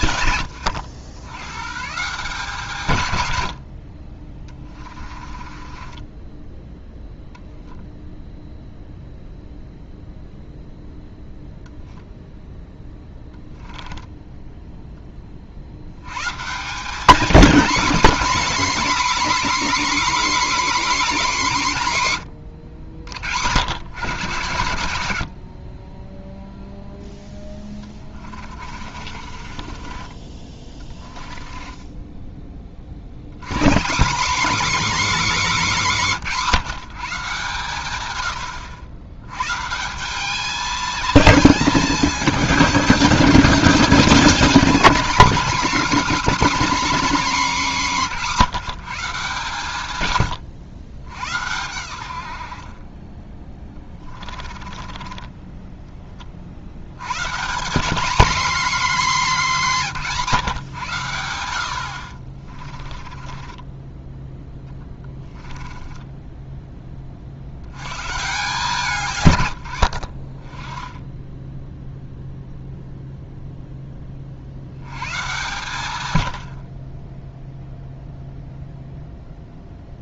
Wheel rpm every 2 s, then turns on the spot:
80, 130, 30, 10, 0, 0, 10, 10, 190, 280, 270, 80, 100, 0, 40, 20, 50, 280, 170, 90, 220, 210, 240, 280, 170, 100, 30, 30, 110, 230, 120, 30, 10, 20, 150, 20, 0, 100, 30, 0.
4-6 28-32 54-56 62-66